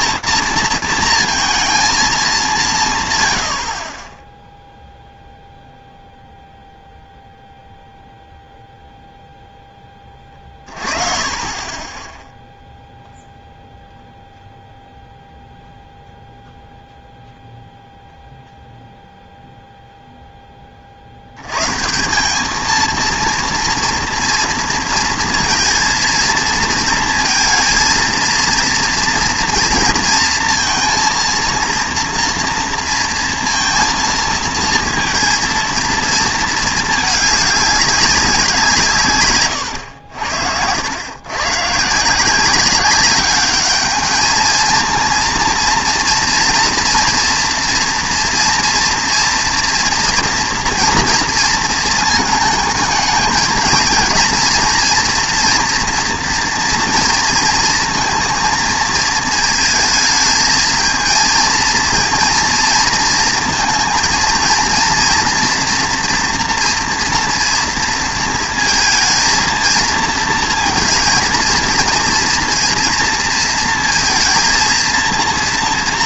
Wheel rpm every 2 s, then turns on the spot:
230, 170, 0, 0, 0, 30, 0, 0, 0, 0, 50, 220, 230, 230, 230, 230, 230, 230, 210, 150, 100, 190, 230, 230, 230, 240, 210, 230, 230, 230, 220, 230, 230, 240, 230, 230, 230, 230.
none